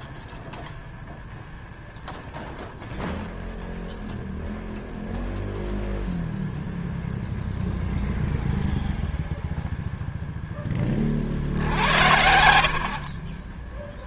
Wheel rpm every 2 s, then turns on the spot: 0, 0, 0, 0, 0, 10, 70.
12-14